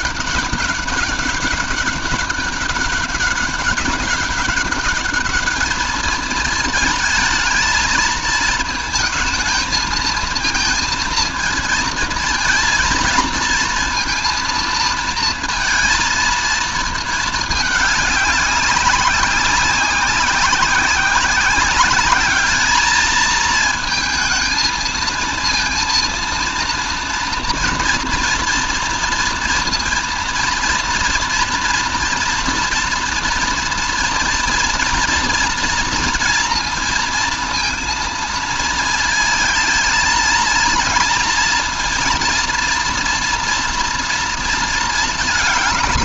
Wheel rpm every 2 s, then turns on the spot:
200, 200, 200, 220, 220, 220, 230, 230, 220, 190, 190, 210, 230, 230, 230, 230, 230, 230, 230, 230, 230, 230, 230.
none